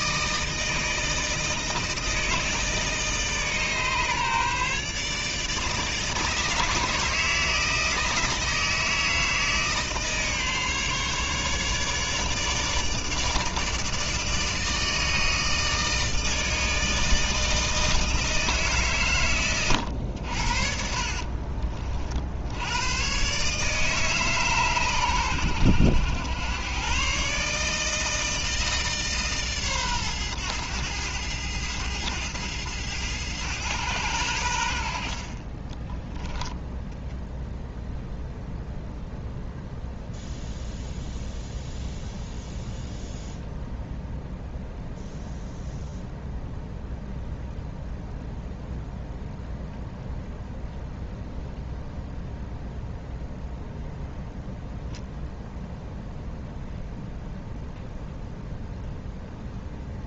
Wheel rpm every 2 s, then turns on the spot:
160, 160, 150, 160, 160, 150, 150, 160, 160, 150, 60, 90, 130, 120, 160, 110, 110, 80, 0, 0, 0, 0, 0, 0, 0, 0, 0, 0, 0, 0.
20-22